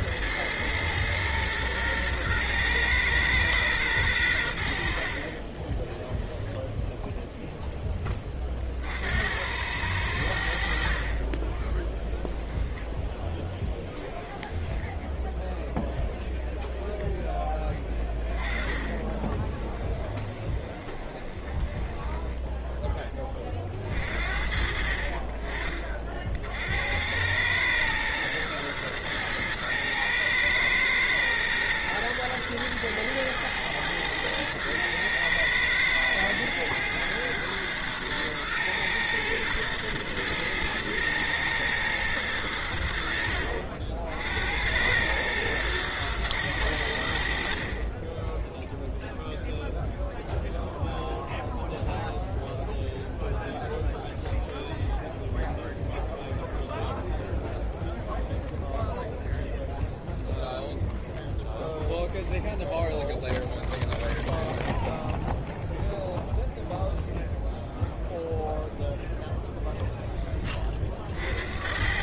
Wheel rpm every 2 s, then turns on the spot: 110, 120, 90, 0, 30, 70, 0, 20, 0, 10, 20, 10, 50, 60, 110, 110, 110, 110, 110, 110, 110, 90, 80, 100, 0, 0, 0, 0, 0, 0, 0, 0, 0, 0, 0, 30.
14-16 18-24